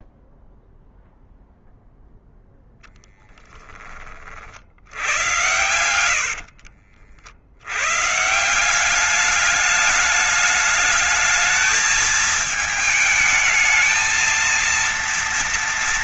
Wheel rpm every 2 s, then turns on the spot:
0, 10, 90, 70, 190, 210, 220, 230.
none